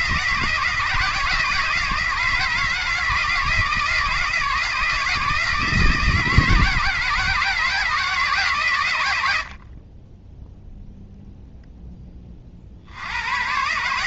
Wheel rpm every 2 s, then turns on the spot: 160, 160, 160, 160, 140, 0, 50.
none